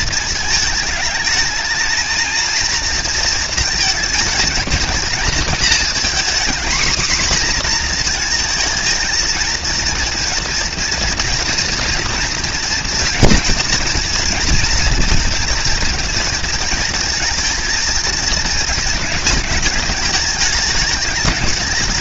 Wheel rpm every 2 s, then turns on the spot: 230, 210, 230, 230, 250, 230, 230, 230, 220, 220, 210.
none